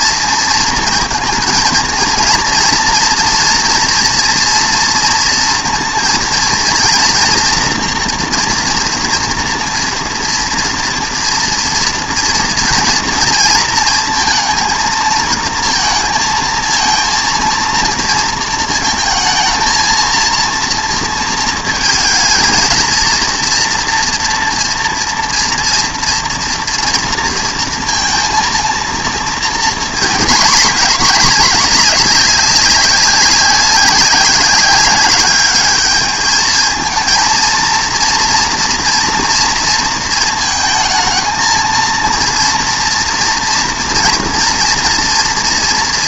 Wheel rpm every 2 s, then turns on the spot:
230, 230, 230, 230, 230, 230, 230, 230, 230, 220, 230, 230, 230, 230, 230, 220, 200, 190, 220, 240, 230, 230, 230.
none